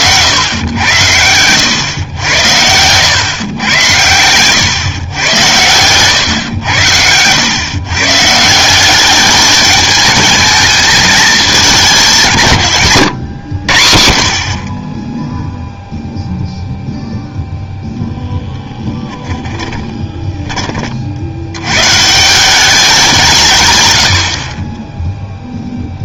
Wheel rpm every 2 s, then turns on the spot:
100, 90, 110, 100, 160, 220, 140, 40, 0, 10, 30, 180, 40.
18-20